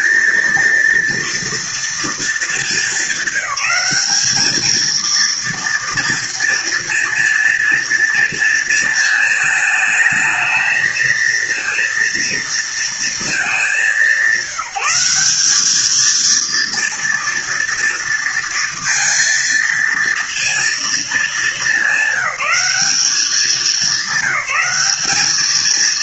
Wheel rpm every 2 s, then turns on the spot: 230, 220, 220, 230, 220, 220, 230, 180, 230, 230, 230, 210, 200.
none